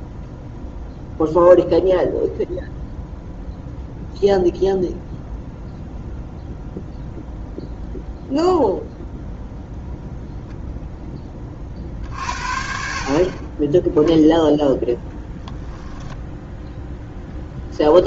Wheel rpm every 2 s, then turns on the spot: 0, 0, 0, 0, 0, 10, 40, 0, 0.
none